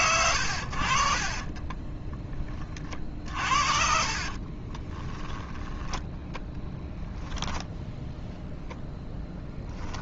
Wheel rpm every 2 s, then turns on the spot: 70, 30, 30, 10, 0.
4-6